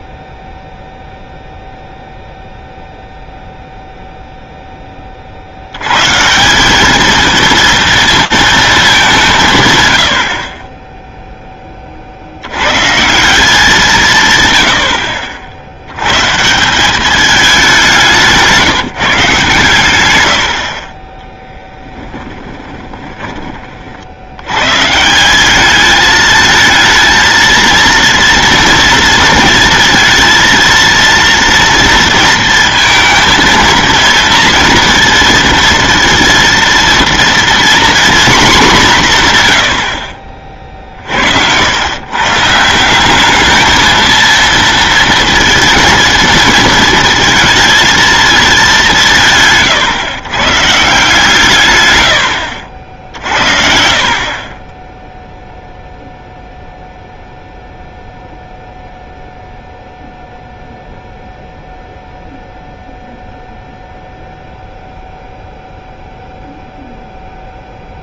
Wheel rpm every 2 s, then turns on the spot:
0, 0, 0, 180, 220, 40, 90, 120, 170, 170, 80, 10, 150, 220, 230, 230, 230, 230, 240, 190, 50, 180, 230, 220, 140, 140, 60, 10, 0, 0, 0, 0, 0, 0.
22-24